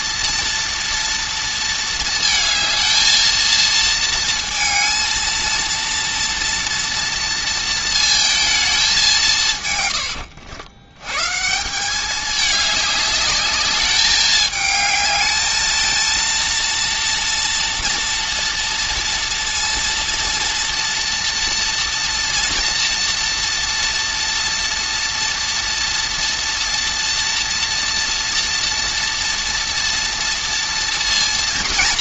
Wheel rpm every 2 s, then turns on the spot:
230, 220, 220, 230, 210, 100, 200, 210, 230, 230, 230, 230, 230, 240, 240, 230.
none